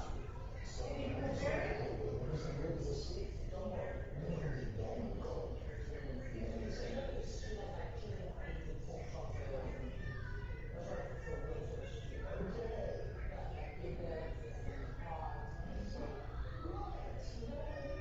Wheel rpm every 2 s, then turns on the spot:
0, 0, 0, 0, 0, 0, 0, 0, 0.
none